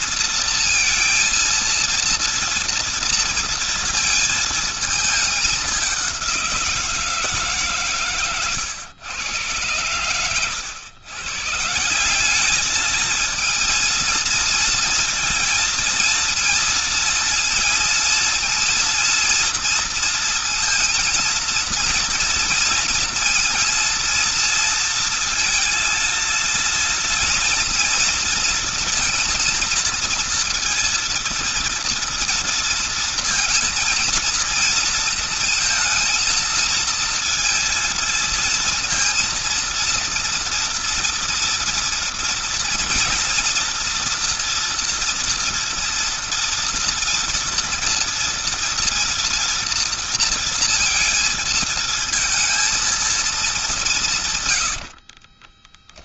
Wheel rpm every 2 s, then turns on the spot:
230, 230, 220, 170, 120, 110, 220, 230, 230, 230, 230, 230, 230, 230, 230, 230, 230, 230, 230, 230, 230, 230, 230, 230, 230, 230, 230, 100.
54-56